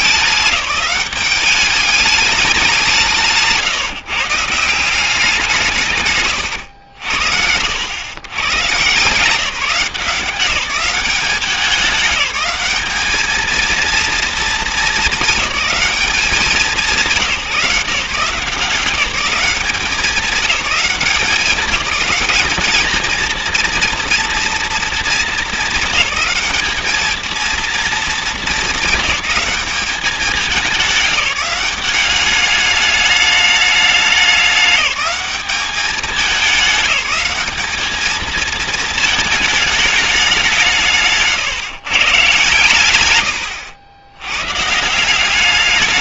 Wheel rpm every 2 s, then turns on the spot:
200, 180, 170, 110, 130, 190, 200, 220, 190, 180, 190, 200, 230, 210, 210, 200, 210, 200, 190, 220, 170, 130, 140.
none